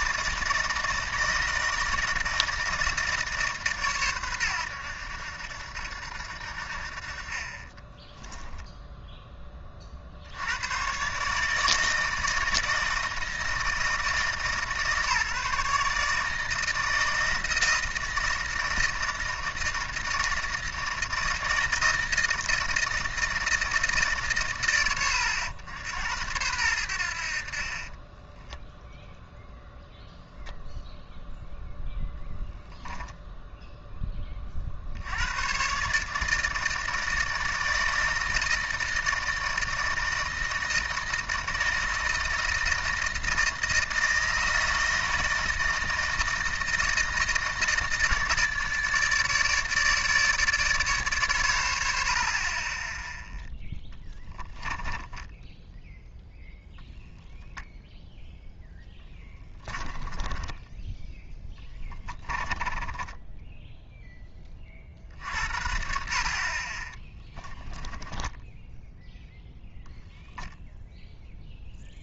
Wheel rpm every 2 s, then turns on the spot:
160, 160, 100, 60, 0, 110, 160, 150, 160, 160, 160, 160, 100, 90, 10, 0, 0, 50, 160, 160, 160, 160, 160, 160, 150, 150, 20, 10, 0, 10, 10, 20, 40, 40, 10, 0.
54-56 58-64 68-70